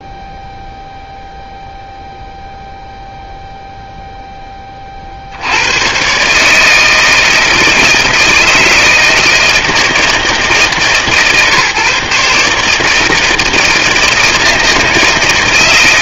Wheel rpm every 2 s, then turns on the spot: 0, 0, 70, 160, 160, 150, 160, 160.
none